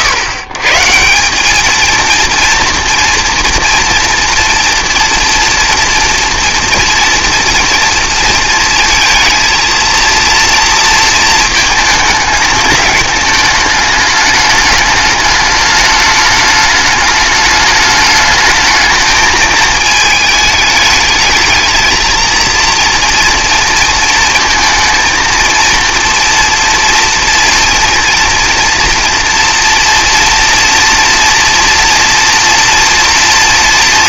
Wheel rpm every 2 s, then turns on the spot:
130, 230, 230, 230, 230, 230, 210, 210, 210, 210, 220, 230, 230, 230, 230, 230, 230.
none